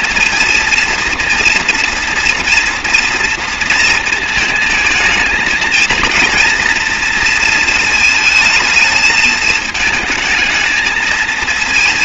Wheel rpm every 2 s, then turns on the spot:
230, 230, 220, 230, 220, 220.
none